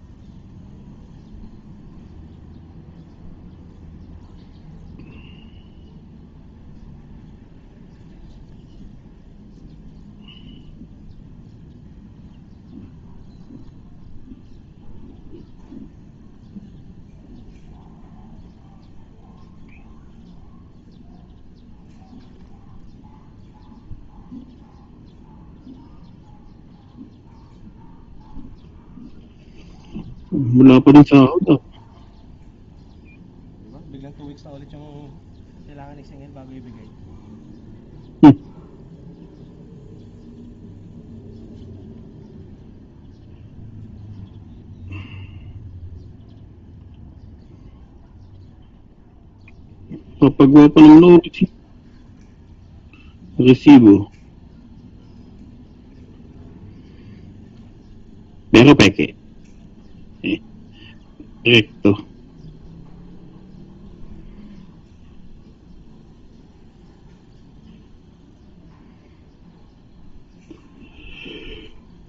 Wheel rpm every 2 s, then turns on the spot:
0, 0, 0, 0, 0, 0, 0, 0, 0, 0, 0, 0, 0, 0, 0, 0, 0, 0, 0, 0, 0, 0, 0, 0, 0, 0, 0, 0, 0, 0, 0, 0, 0, 0, 0, 0.
none